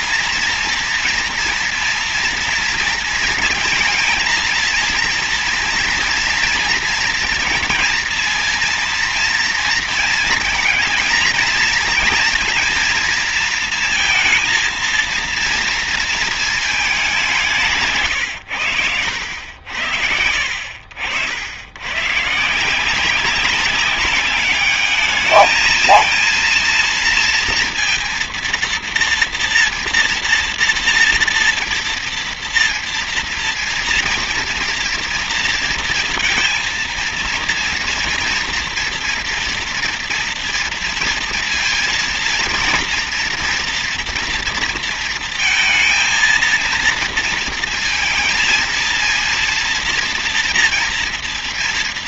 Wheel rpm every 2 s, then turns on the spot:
230, 230, 230, 240, 230, 230, 240, 220, 220, 100, 80, 160, 200, 230, 230, 240, 230, 230, 230, 230, 230, 230, 230, 230, 230, 230.
none